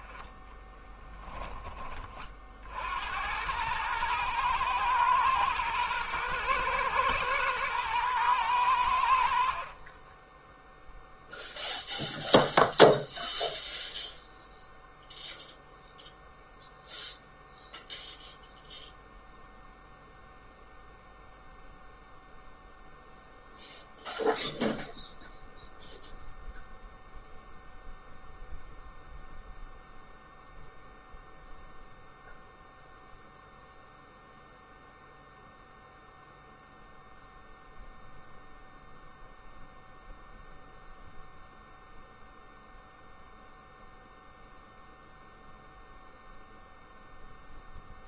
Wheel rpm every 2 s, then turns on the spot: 20, 70, 120, 120, 90, 0, 0, 0, 0, 0, 0, 0, 0, 0, 0, 0, 0, 0, 0, 0, 0, 0, 0, 0.
0-2